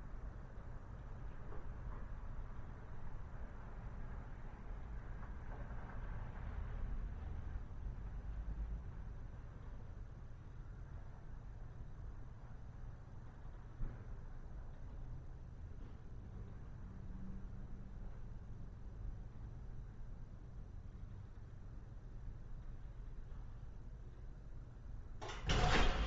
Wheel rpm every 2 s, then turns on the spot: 0, 0, 0, 0, 0, 0, 0, 0, 0, 0, 0, 0, 0.
none